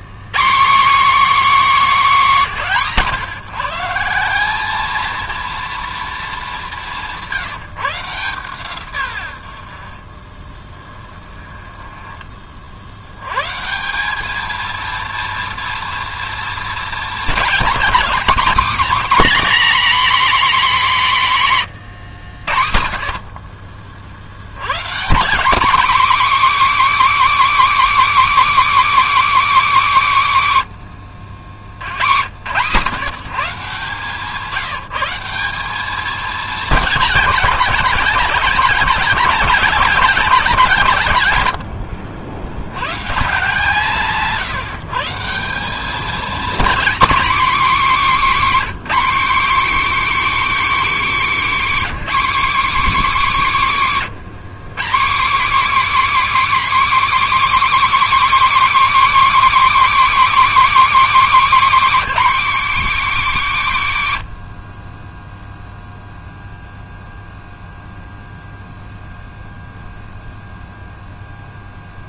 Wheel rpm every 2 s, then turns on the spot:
130, 170, 210, 200, 140, 20, 40, 230, 230, 260, 260, 80, 120, 300, 310, 150, 130, 180, 220, 200, 180, 100, 160, 240, 260, 290, 280, 190, 300, 310, 300, 290, 70, 0, 0, 0.
none